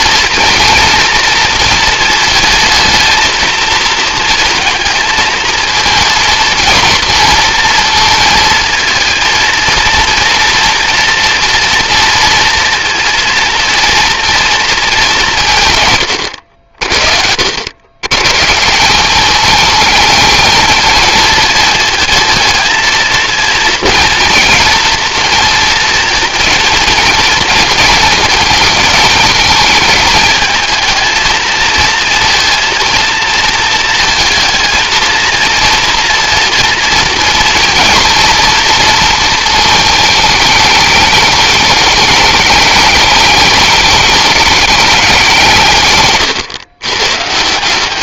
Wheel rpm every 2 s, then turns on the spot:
230, 220, 230, 230, 230, 230, 230, 230, 80, 160, 220, 220, 230, 230, 220, 220, 230, 230, 230, 230, 210, 210, 200, 120.
none